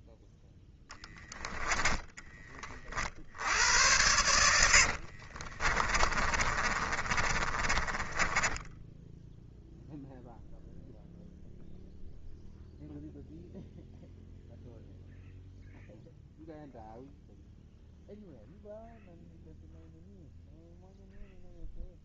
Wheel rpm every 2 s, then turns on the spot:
10, 50, 60, 30, 0, 0, 0, 0, 0, 0, 0.
0-2 4-8